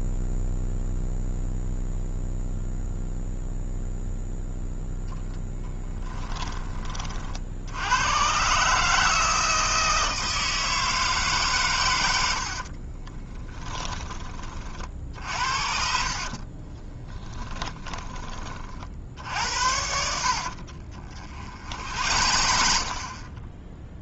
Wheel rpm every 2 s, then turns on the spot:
0, 0, 0, 30, 150, 160, 50, 40, 20, 40, 50, 60.
12-14 16-18 20-24